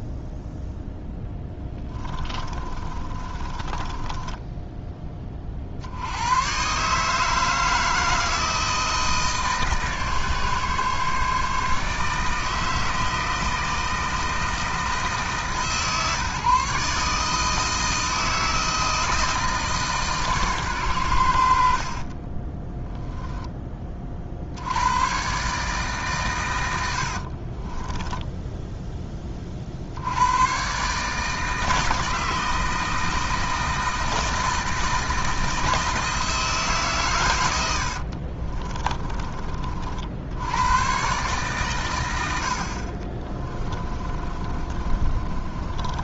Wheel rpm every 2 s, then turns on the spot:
10, 40, 20, 140, 160, 140, 160, 160, 150, 160, 120, 10, 110, 80, 10, 140, 160, 160, 140, 20, 130, 50, 30.
2-4 22-24 38-40 42-46